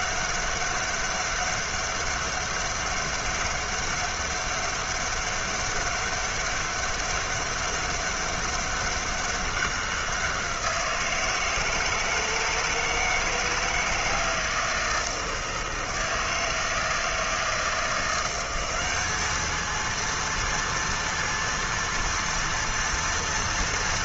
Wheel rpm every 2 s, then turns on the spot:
200, 200, 200, 200, 200, 180, 160, 160, 160, 180, 230, 230.
none